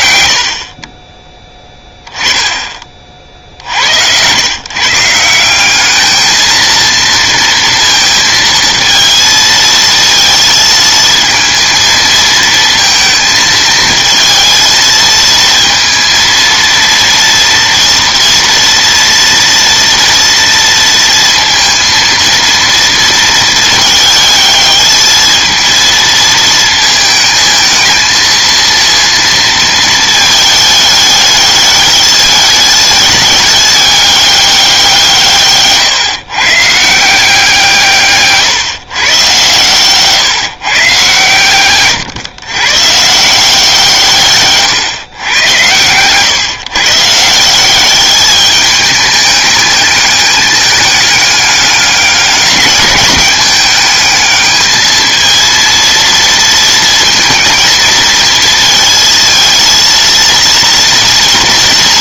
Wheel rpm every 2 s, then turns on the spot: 50, 30, 130, 230, 230, 230, 230, 220, 230, 230, 230, 230, 220, 220, 230, 210, 210, 190, 140, 150, 140, 130, 130, 140, 210, 210, 210, 220, 230, 230, 230.
none